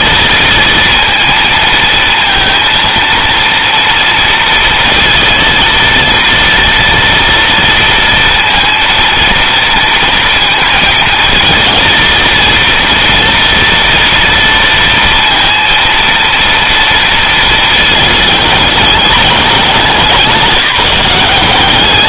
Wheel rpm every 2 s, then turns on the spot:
230, 230, 230, 230, 230, 230, 230, 230, 230, 210, 180.
none